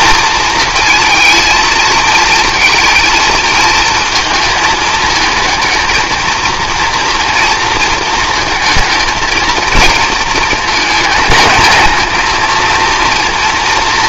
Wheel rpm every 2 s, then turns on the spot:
220, 230, 220, 230, 230, 220, 230.
none